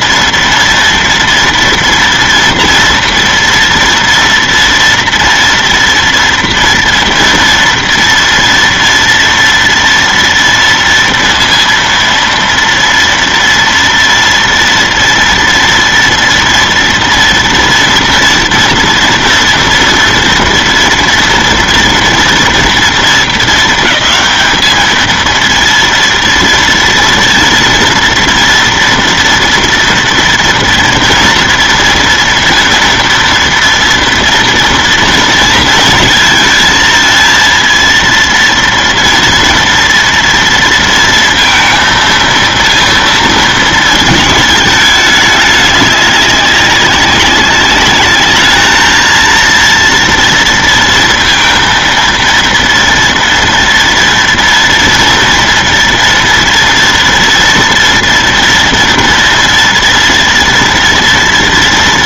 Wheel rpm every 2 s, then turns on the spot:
230, 230, 230, 230, 230, 230, 230, 230, 230, 240, 240, 220, 210, 230, 240, 230, 230, 230, 230, 230, 230, 230, 210, 200, 220, 230, 230, 230, 230, 230, 230.
none